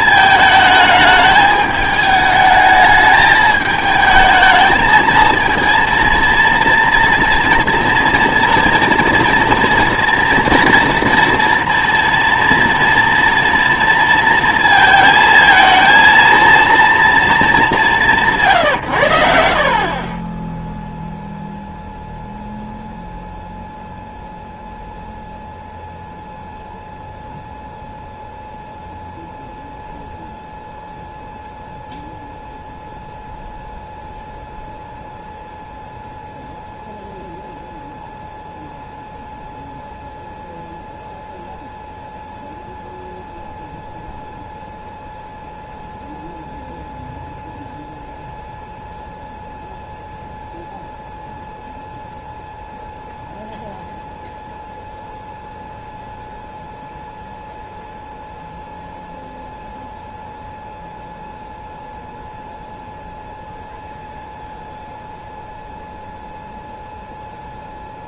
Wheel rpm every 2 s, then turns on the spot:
220, 210, 220, 230, 240, 230, 230, 230, 230, 140, 0, 0, 0, 0, 0, 0, 0, 0, 0, 0, 0, 0, 0, 0, 0, 0, 0, 0, 0, 0, 0, 0, 0, 0.
none